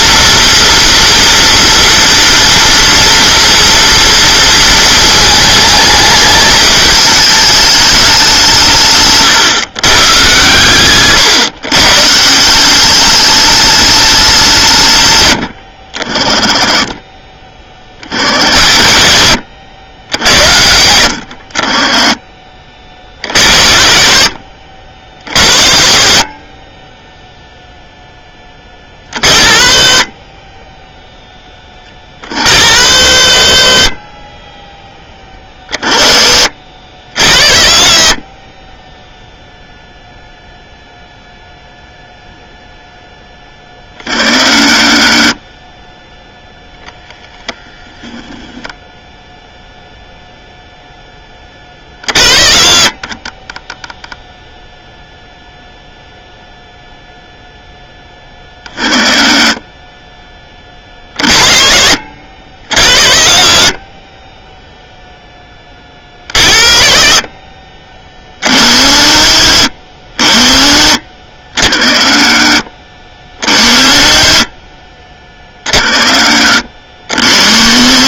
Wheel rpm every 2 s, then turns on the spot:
230, 230, 220, 210, 150, 130, 190, 150, 20, 70, 90, 40, 70, 30, 40, 10, 110, 20, 70, 30, 0, 0, 50, 0, 10, 0, 50, 0, 0, 30, 50, 90, 0, 60, 60, 40, 50, 40, 50.
30-32 34-36